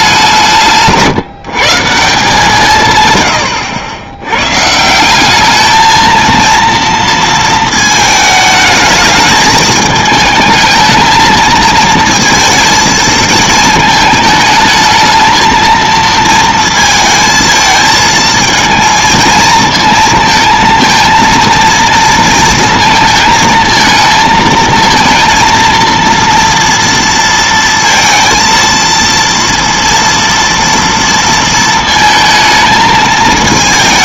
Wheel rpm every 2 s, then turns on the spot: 150, 150, 120, 230, 210, 220, 230, 220, 230, 230, 220, 230, 230, 230, 230, 230, 220.
none